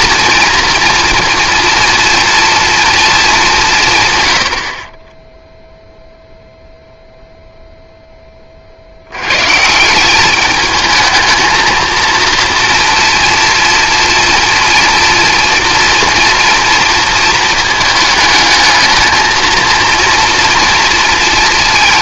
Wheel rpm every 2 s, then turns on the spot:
230, 230, 90, 0, 70, 220, 230, 240, 230, 220, 230.
none